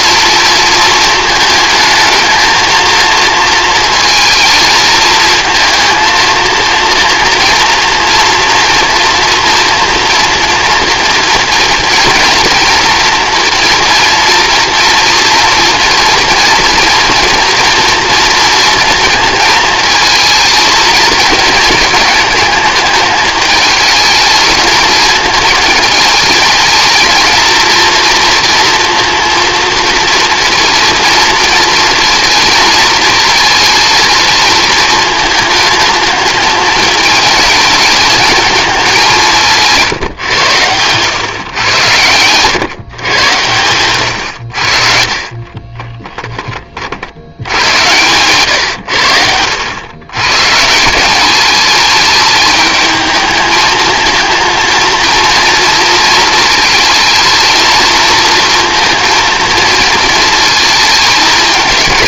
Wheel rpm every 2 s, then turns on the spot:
230, 220, 230, 240, 240, 230, 230, 230, 230, 230, 220, 220, 220, 220, 230, 230, 220, 220, 220, 210, 110, 130, 50, 30, 110, 160, 220, 220, 220, 230, 220.
none